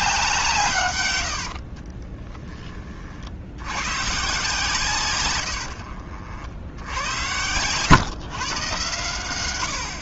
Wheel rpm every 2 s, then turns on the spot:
130, 40, 150, 80, 120.
none